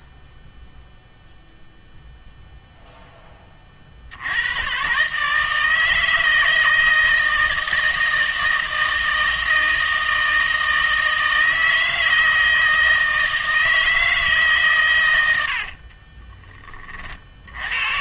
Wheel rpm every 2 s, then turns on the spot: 0, 0, 120, 160, 160, 160, 160, 130, 30.
none